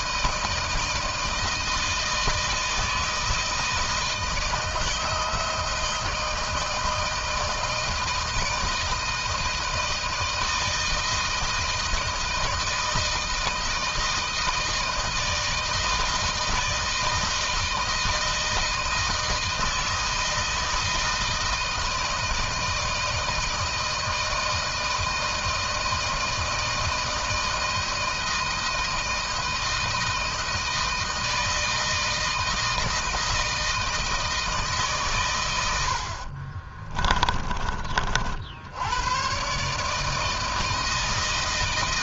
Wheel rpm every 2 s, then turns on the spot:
160, 160, 160, 160, 160, 160, 160, 160, 160, 160, 160, 160, 160, 160, 160, 160, 160, 140, 30, 80, 160.
36-38